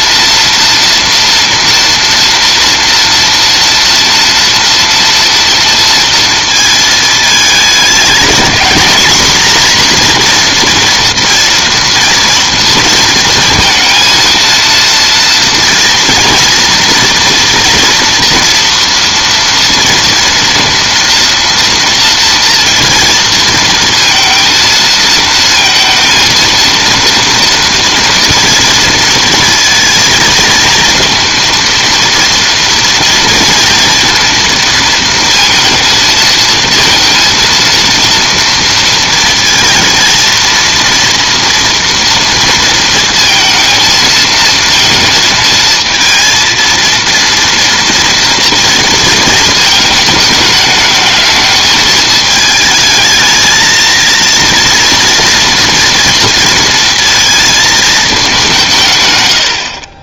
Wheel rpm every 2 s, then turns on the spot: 230, 230, 230, 220, 230, 230, 230, 230, 230, 230, 230, 230, 230, 230, 230, 230, 230, 230, 230, 230, 230, 230, 220, 230, 230, 210, 220, 230, 230, 150.
none